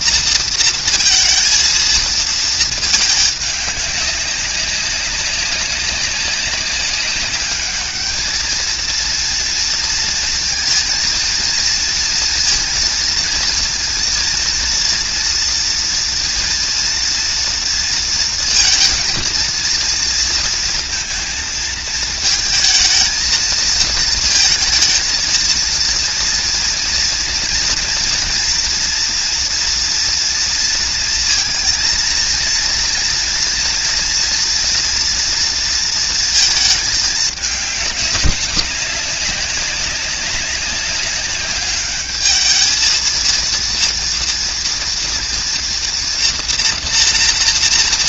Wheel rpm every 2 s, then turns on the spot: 230, 220, 200, 200, 220, 230, 230, 230, 230, 230, 230, 220, 230, 230, 230, 230, 230, 230, 230, 200, 200, 220, 230, 240.
none